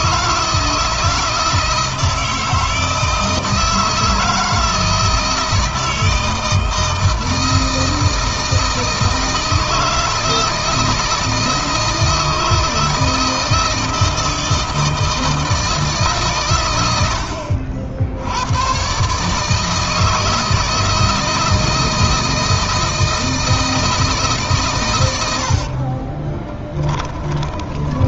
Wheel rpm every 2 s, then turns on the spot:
160, 160, 160, 160, 160, 160, 160, 160, 100, 130, 160, 160, 120, 20.
26-28